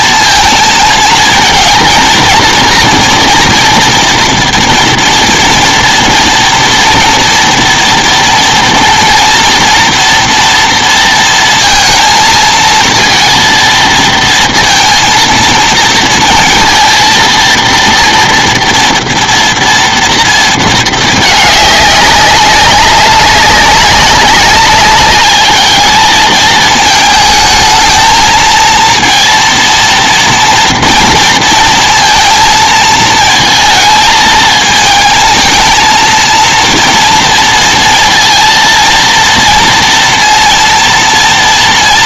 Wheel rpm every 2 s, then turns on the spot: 230, 230, 230, 230, 240, 230, 230, 230, 230, 230, 230, 200, 200, 220, 220, 230, 230, 230, 230, 230, 230.
none